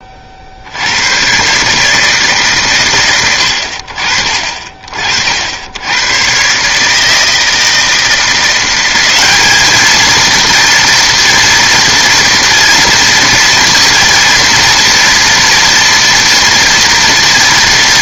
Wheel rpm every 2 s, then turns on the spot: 70, 140, 40, 140, 180, 240, 230, 230, 230.
none